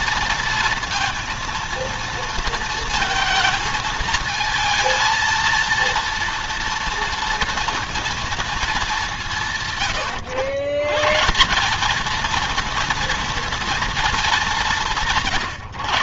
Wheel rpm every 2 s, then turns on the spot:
230, 230, 230, 230, 180, 140, 230, 160.
none